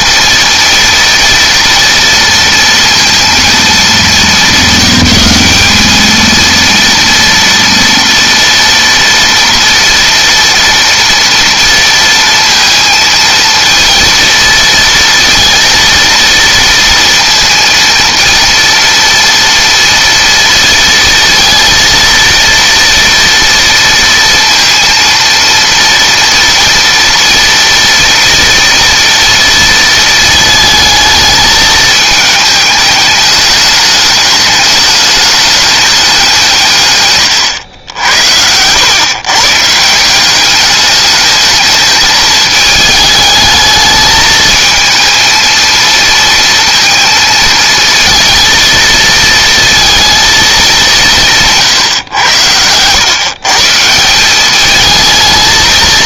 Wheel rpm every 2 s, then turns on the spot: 230, 230, 200, 230, 230, 230, 230, 230, 230, 230, 230, 230, 230, 230, 230, 220, 210, 210, 130, 120, 210, 220, 220, 230, 230, 180, 120, 220.
36-38